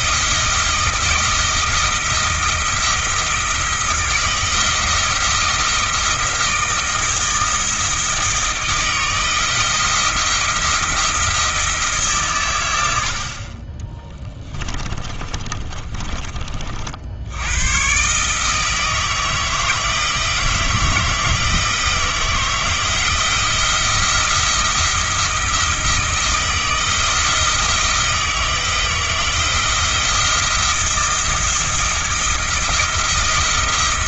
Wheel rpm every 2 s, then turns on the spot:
160, 160, 160, 160, 160, 170, 100, 20, 50, 160, 160, 160, 170, 170, 160, 170, 170.
14-16